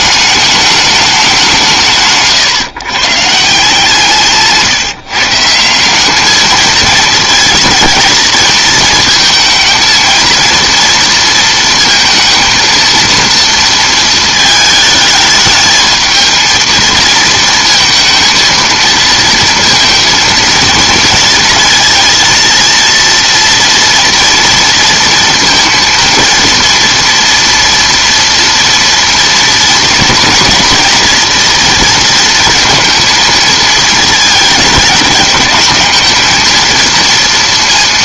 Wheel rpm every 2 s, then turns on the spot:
210, 140, 150, 220, 230, 230, 230, 220, 220, 220, 230, 230, 230, 230, 240, 230, 230, 220, 230.
none